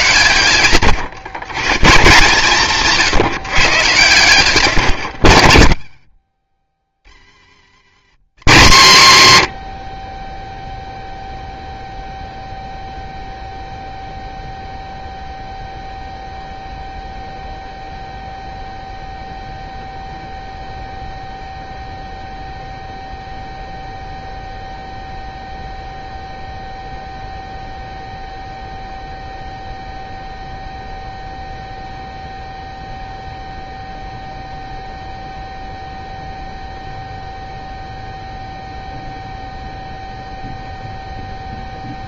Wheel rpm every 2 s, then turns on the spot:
130, 160, 120, 70, 150, 0, 0, 0, 0, 0, 0, 0, 0, 0, 0, 0, 0, 0, 0, 0, 0.
4-6